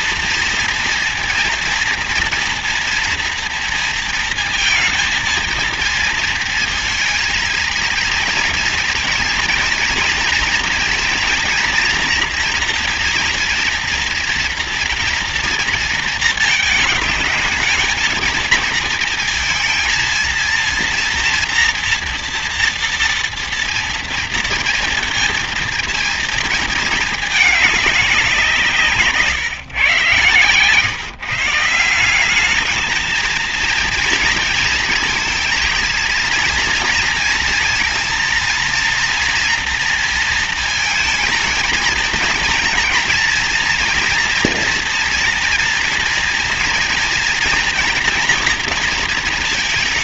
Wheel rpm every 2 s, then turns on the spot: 230, 230, 230, 230, 230, 230, 240, 230, 220, 220, 230, 230, 230, 230, 180, 140, 200, 230, 230, 230, 230, 230, 240, 230, 240.
none